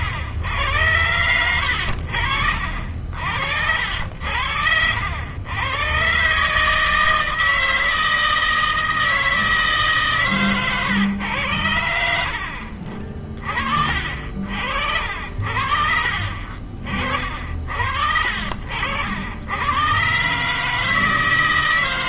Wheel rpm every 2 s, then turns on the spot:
90, 80, 70, 120, 160, 150, 80, 40, 60, 60, 120.
none